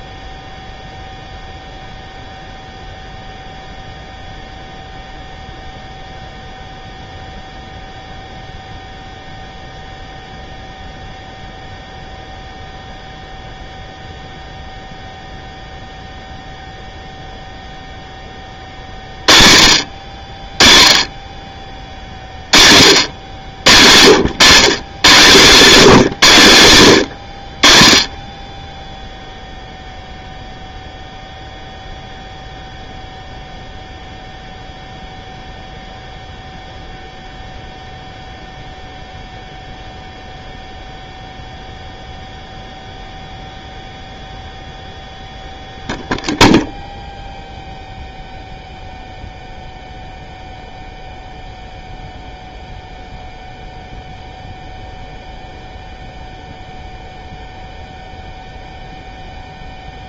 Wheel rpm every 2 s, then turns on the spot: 0, 0, 0, 0, 0, 0, 0, 0, 0, 30, 30, 40, 130, 120, 10, 0, 0, 0, 0, 0, 0, 0, 0, 0, 0, 0, 0, 0, 0, 0.
none